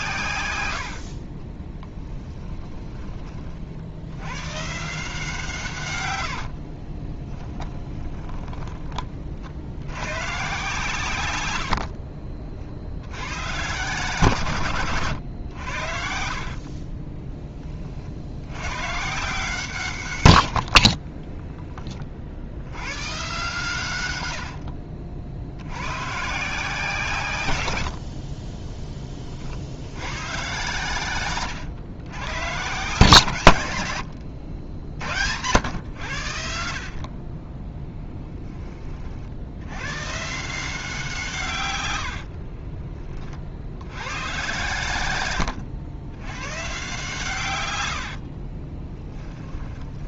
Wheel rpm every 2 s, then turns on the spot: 90, 20, 150, 30, 30, 130, 50, 130, 40, 130, 60, 90, 50, 150, 20, 120, 140, 70, 50, 30, 180, 30, 110, 140, 30.
0-4 6-8 24-26 42-44 48-50